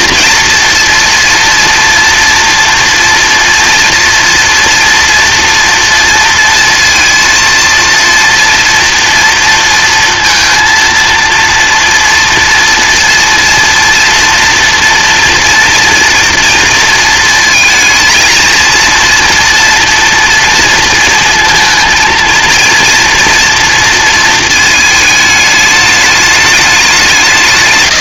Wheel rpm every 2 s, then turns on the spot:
230, 230, 230, 230, 230, 230, 230, 240, 230, 230, 230, 230, 220, 200.
none